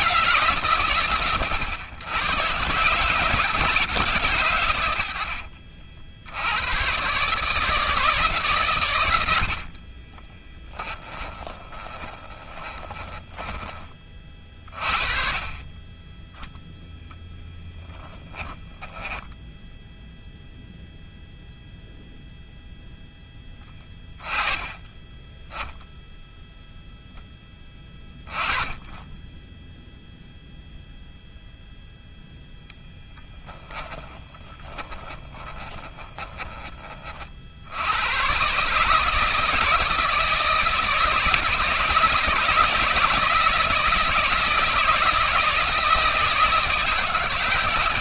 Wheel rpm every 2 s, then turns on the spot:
120, 150, 70, 120, 90, 20, 10, 50, 0, 10, 0, 10, 20, 10, 20, 0, 10, 20, 40, 150, 160, 160, 160, 150.
8-14 18-20 34-36